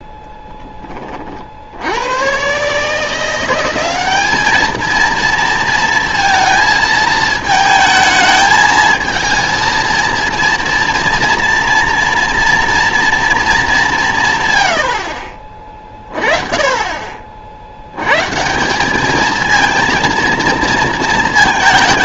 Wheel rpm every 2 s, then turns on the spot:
10, 140, 220, 230, 220, 230, 230, 90, 30, 170, 220.
none